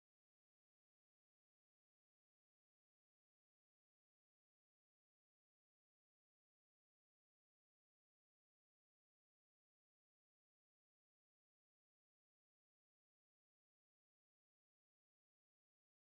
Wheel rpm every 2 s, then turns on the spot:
0, 0, 0, 0, 0, 0, 0, 0.
none